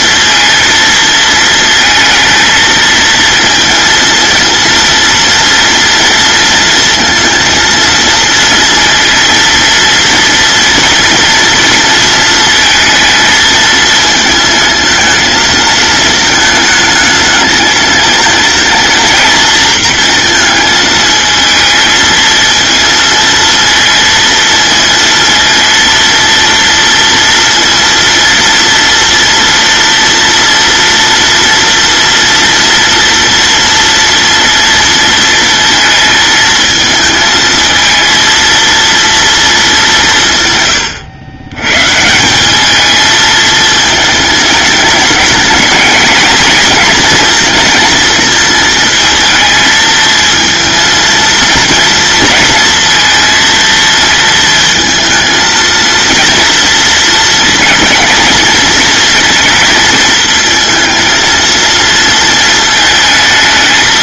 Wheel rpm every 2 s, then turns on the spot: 230, 230, 230, 230, 230, 230, 230, 220, 220, 230, 220, 230, 230, 230, 230, 230, 230, 230, 220, 230, 110, 220, 210, 240, 220, 230, 230, 220, 220, 230, 220, 220.
none